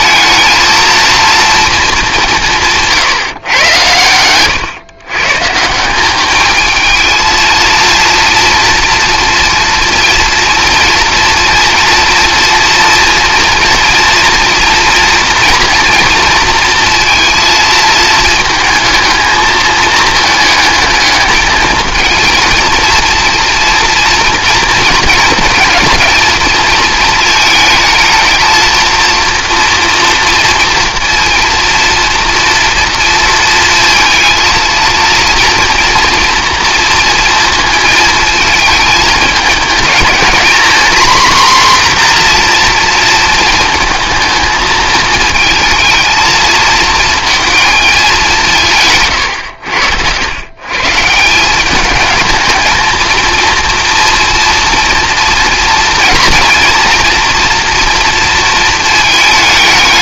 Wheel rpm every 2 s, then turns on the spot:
230, 160, 120, 220, 230, 230, 230, 230, 230, 220, 210, 230, 230, 220, 230, 230, 230, 230, 230, 220, 240, 240, 220, 220, 160, 130, 220, 230, 230, 220.
none